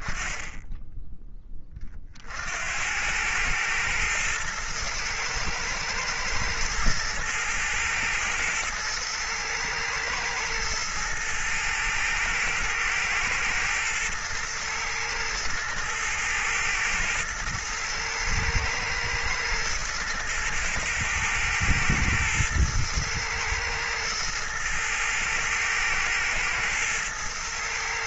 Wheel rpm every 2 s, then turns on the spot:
10, 60, 110, 110, 110, 120, 110, 110, 110, 110, 110, 110, 110, 120.
none